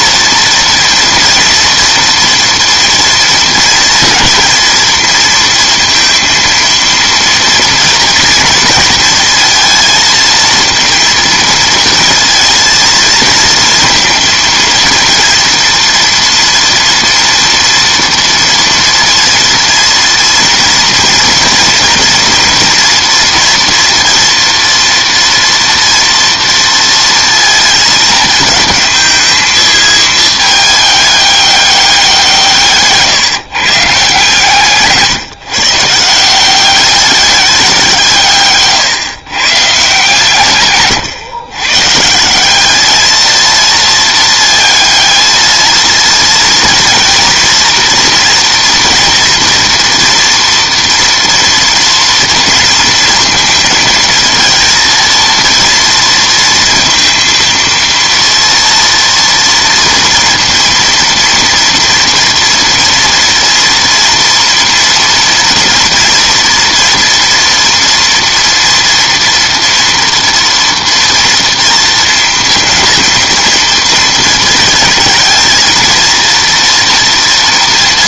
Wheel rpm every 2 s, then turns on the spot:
230, 230, 230, 230, 230, 230, 230, 230, 230, 240, 230, 240, 230, 230, 220, 210, 160, 150, 180, 140, 140, 200, 220, 220, 230, 240, 230, 230, 230, 230, 230, 230, 230, 240, 230, 230, 230, 230, 230.
38-40